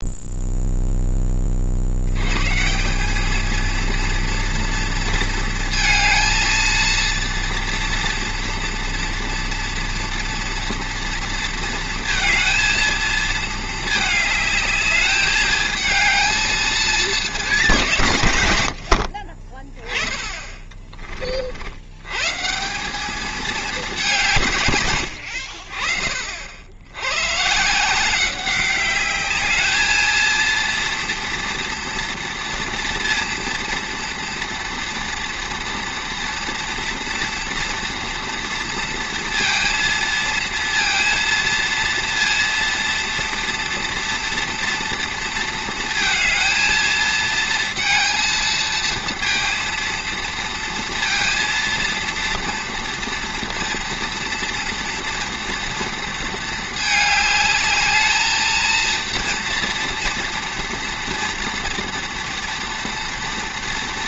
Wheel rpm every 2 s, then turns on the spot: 0, 160, 230, 230, 240, 240, 230, 220, 220, 80, 20, 170, 130, 80, 200, 230, 230, 230, 230, 230, 220, 230, 230, 230, 230, 230, 230, 230, 220, 220, 240, 240.
20-22